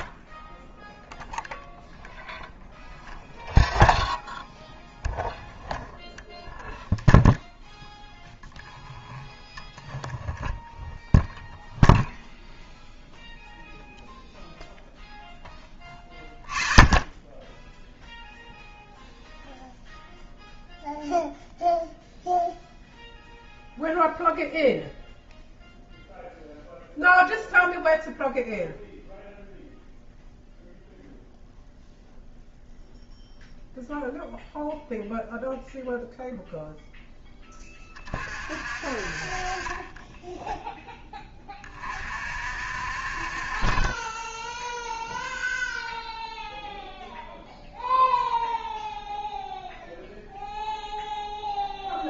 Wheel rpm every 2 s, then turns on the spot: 0, 0, 0, 0, 0, 0, 0, 0, 0, 0, 0, 0, 0, 0, 0, 0, 0, 0, 0, 40, 10, 50, 0, 0, 0, 0.
none